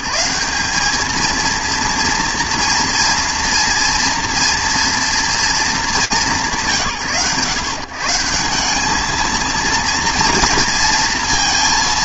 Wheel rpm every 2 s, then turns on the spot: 170, 230, 240, 130, 190, 230.
none